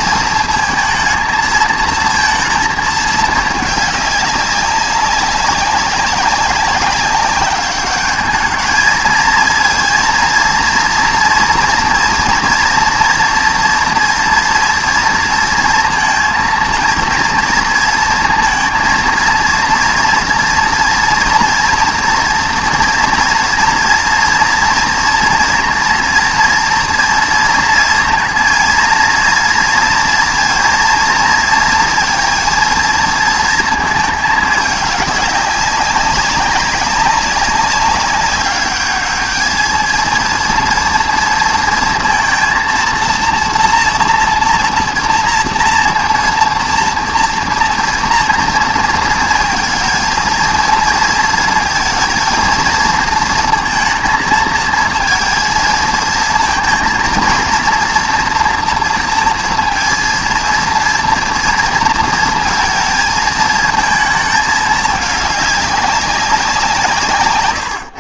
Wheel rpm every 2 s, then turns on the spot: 220, 230, 200, 200, 220, 230, 240, 230, 230, 230, 230, 230, 230, 230, 230, 230, 230, 210, 190, 210, 230, 230, 230, 230, 230, 230, 230, 220, 230, 230, 230, 230, 210, 170.
none